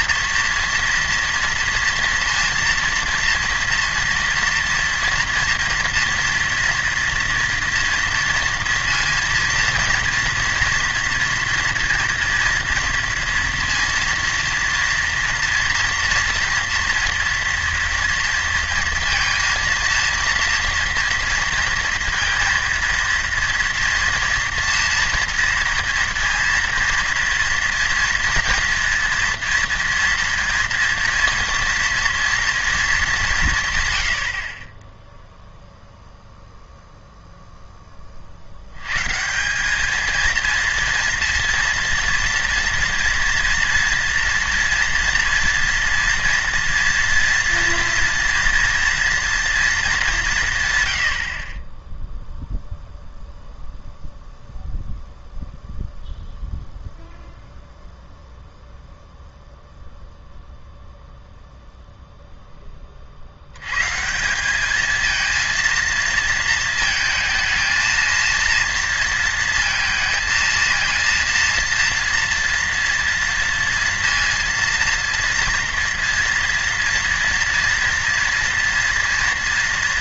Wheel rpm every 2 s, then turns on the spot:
230, 230, 230, 240, 230, 230, 230, 230, 230, 230, 230, 230, 240, 230, 230, 230, 230, 50, 0, 70, 230, 230, 240, 230, 230, 160, 0, 0, 0, 0, 0, 10, 200, 230, 230, 230, 240, 230, 230, 230.
none